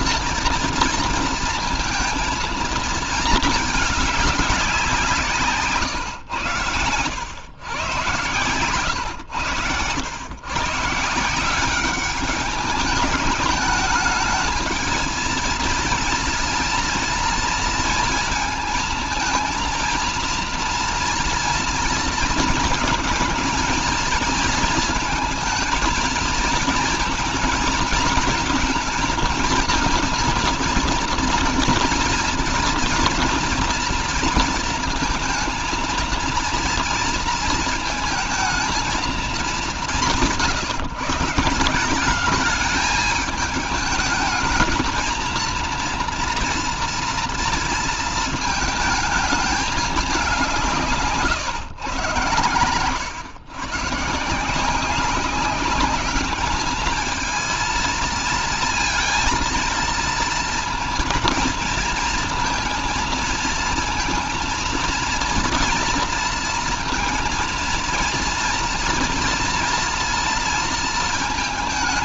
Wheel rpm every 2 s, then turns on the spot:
230, 230, 180, 100, 120, 150, 200, 220, 230, 220, 230, 230, 220, 220, 230, 230, 240, 230, 230, 230, 160, 210, 220, 230, 220, 160, 100, 190, 220, 230, 230, 230, 230, 230, 230, 230.
50-52